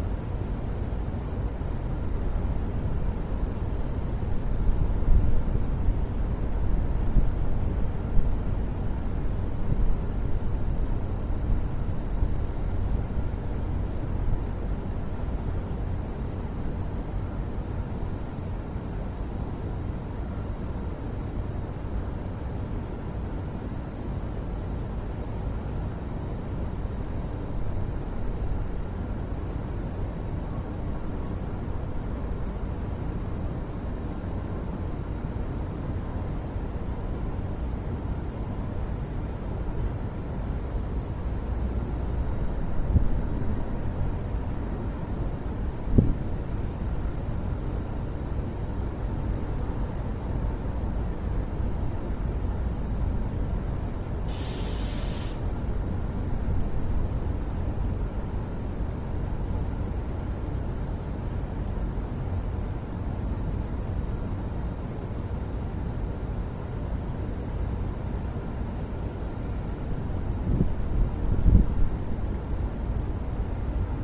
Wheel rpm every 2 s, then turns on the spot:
0, 0, 0, 0, 0, 0, 0, 0, 0, 0, 0, 0, 0, 0, 0, 0, 0, 0, 0, 0, 0, 0, 0, 0, 0, 0, 0, 0, 0, 0, 0, 0, 0, 0, 0, 0, 0.
none